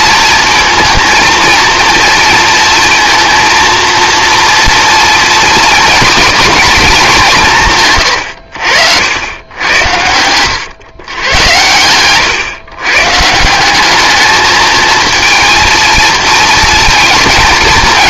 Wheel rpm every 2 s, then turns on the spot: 220, 230, 230, 230, 80, 110, 130, 220, 230.
none